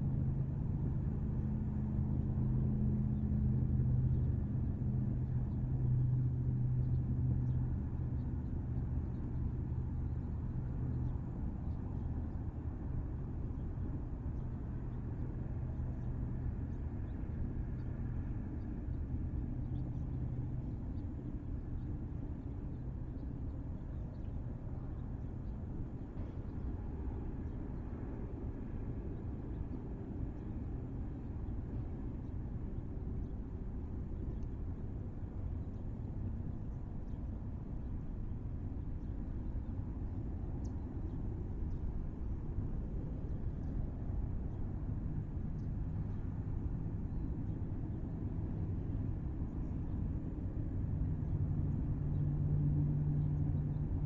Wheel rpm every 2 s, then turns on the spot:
0, 0, 0, 0, 0, 0, 0, 0, 0, 0, 0, 0, 0, 0, 0, 0, 0, 0, 0, 0, 0, 0, 0, 0, 0, 0, 0.
none